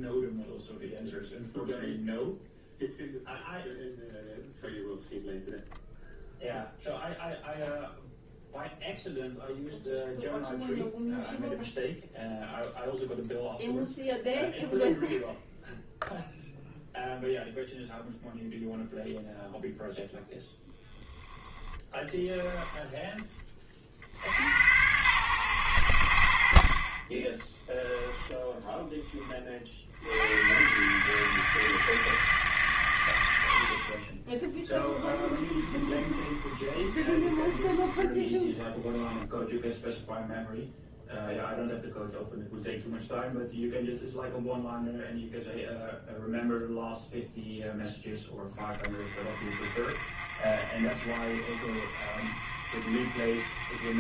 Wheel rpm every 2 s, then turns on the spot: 0, 0, 0, 0, 0, 0, 0, 0, 0, 0, 0, 10, 90, 50, 10, 120, 120, 10, 30, 10, 0, 0, 0, 0, 20, 40, 40.
34-38